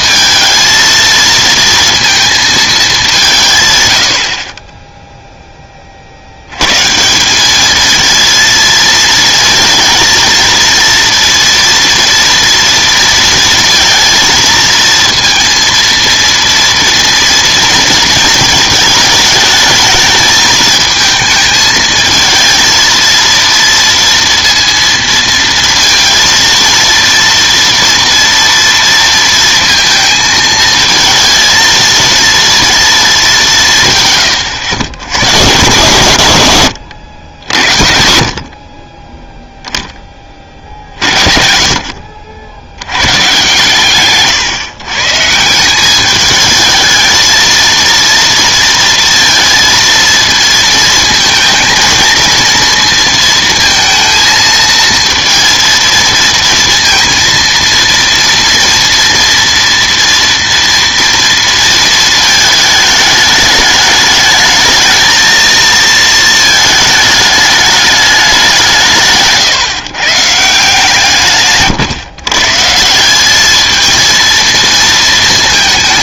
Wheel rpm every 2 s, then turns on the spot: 220, 220, 30, 130, 230, 230, 230, 230, 230, 220, 220, 230, 230, 230, 230, 220, 230, 100, 100, 40, 50, 90, 140, 220, 230, 230, 230, 220, 220, 230, 230, 220, 220, 220, 170, 150, 150, 220.
none